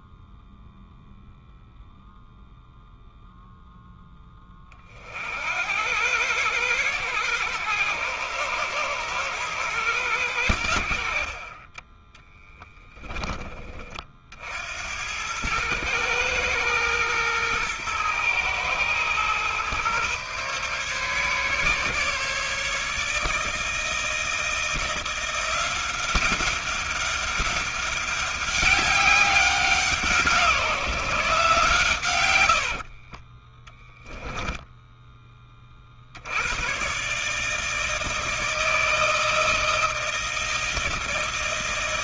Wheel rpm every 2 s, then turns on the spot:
0, 0, 20, 110, 110, 80, 10, 80, 120, 120, 140, 150, 170, 200, 200, 170, 80, 10, 110, 160, 160.
32-36